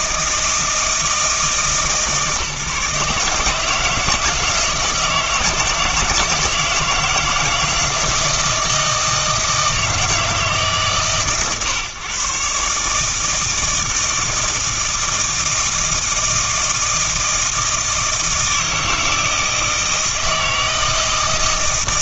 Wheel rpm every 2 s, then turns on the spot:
160, 150, 160, 160, 160, 140, 150, 160, 160, 160, 160.
none